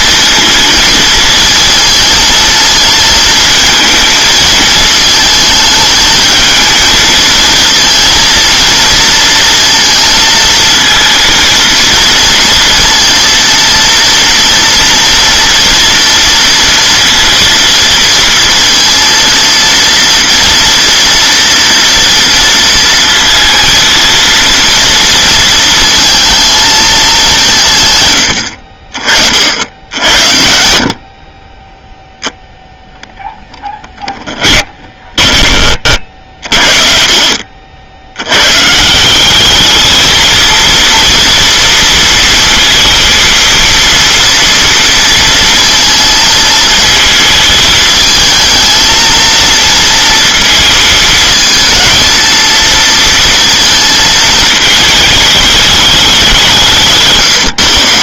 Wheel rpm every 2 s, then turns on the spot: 230, 230, 220, 220, 230, 220, 230, 230, 230, 230, 230, 230, 230, 220, 70, 70, 0, 20, 60, 120, 230, 230, 230, 230, 220, 230, 230, 220, 180.
34-36